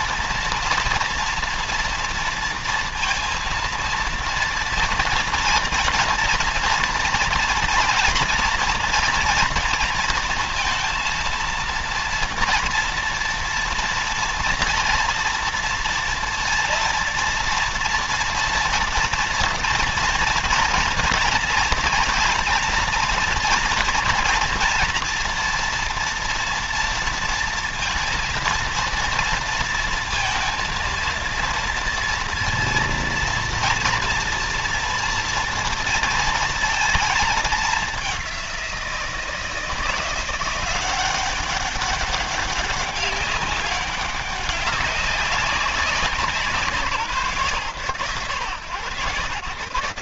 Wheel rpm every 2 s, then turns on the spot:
230, 230, 230, 230, 240, 230, 230, 230, 230, 230, 240, 230, 230, 230, 230, 230, 230, 230, 230, 200, 170, 200, 200, 190, 140.
none